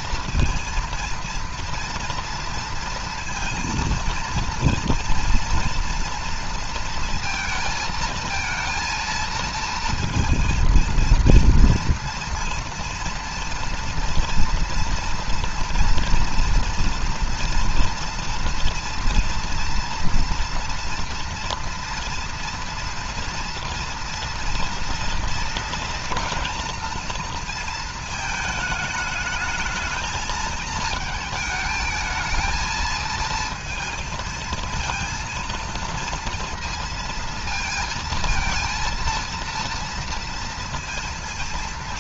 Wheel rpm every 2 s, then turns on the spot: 230, 230, 230, 230, 230, 230, 230, 230, 230, 230, 230, 230, 230, 230, 220, 220, 220, 230, 230, 230, 230.
none